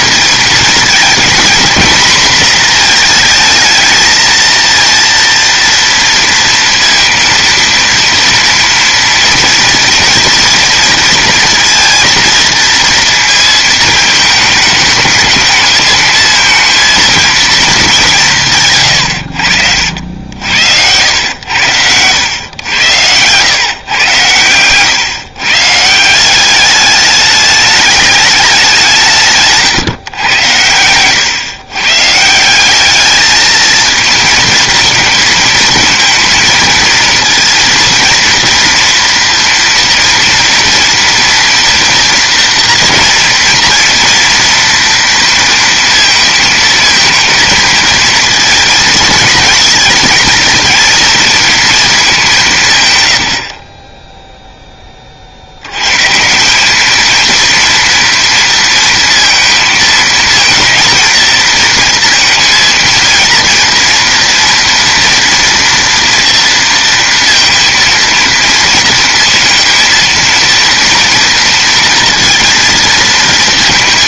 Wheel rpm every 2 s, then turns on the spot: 220, 230, 230, 230, 230, 230, 230, 220, 230, 150, 90, 100, 110, 200, 200, 100, 190, 220, 230, 230, 230, 240, 230, 220, 230, 220, 160, 10, 190, 230, 230, 230, 240, 230, 230, 230, 230.
none